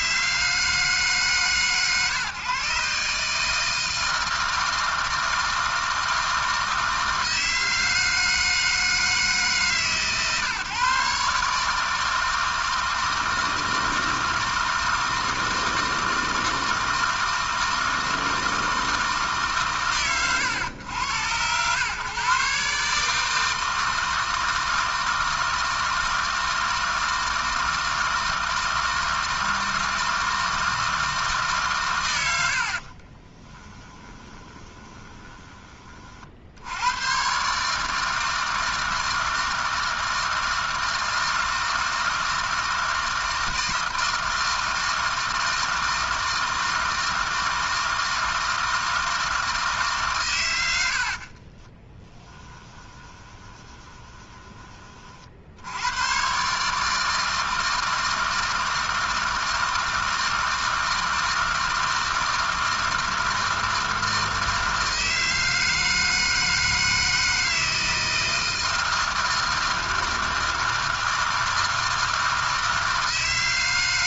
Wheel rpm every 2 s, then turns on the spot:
160, 140, 160, 160, 160, 140, 160, 160, 160, 160, 100, 140, 160, 160, 160, 160, 40, 20, 90, 160, 160, 160, 160, 160, 160, 80, 20, 30, 150, 160, 160, 160, 160, 160, 160, 160, 160.
32-36 52-54